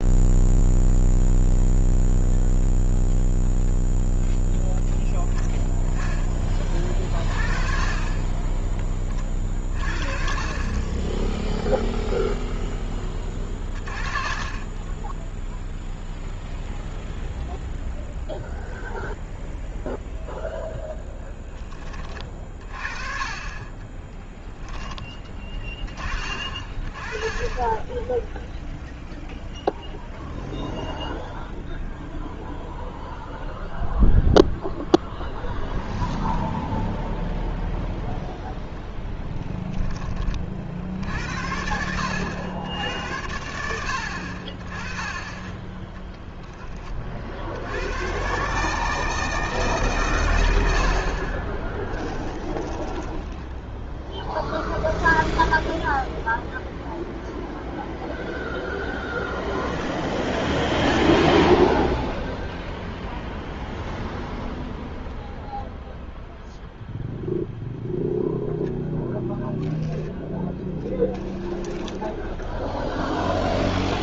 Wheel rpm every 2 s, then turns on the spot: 0, 0, 0, 30, 20, 20, 10, 10, 0, 0, 0, 30, 10, 20, 0, 0, 0, 0, 0, 10, 60, 90, 20, 20, 150, 70, 20, 0, 0, 0, 20, 0, 0, 0, 0, 20, 0.
38-40 52-54 70-72